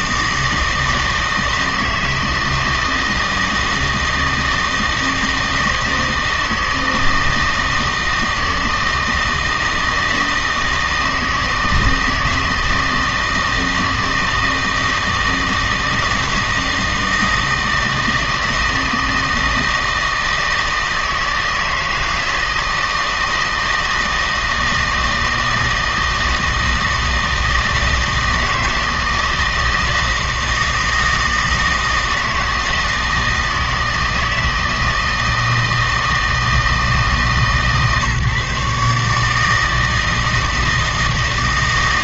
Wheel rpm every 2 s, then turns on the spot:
160, 160, 160, 160, 160, 160, 160, 160, 160, 160, 160, 160, 160, 160, 160, 160, 160, 160, 160, 150, 160.
none